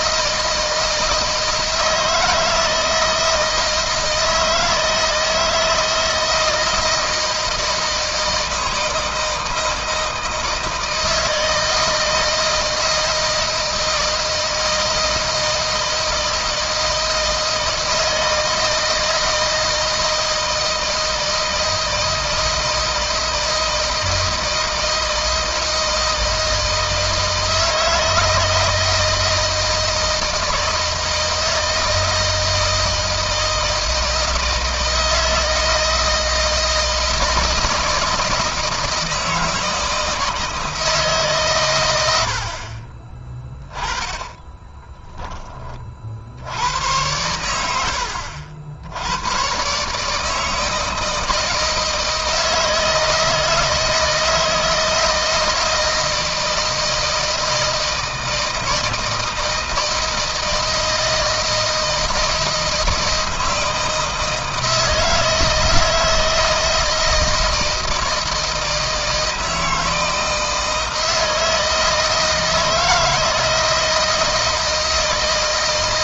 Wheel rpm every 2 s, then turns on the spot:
160, 160, 160, 160, 160, 160, 160, 160, 160, 160, 160, 160, 160, 160, 160, 160, 160, 160, 160, 160, 160, 60, 10, 70, 80, 160, 160, 160, 160, 160, 160, 160, 160, 160, 160, 160, 160, 160.
44-46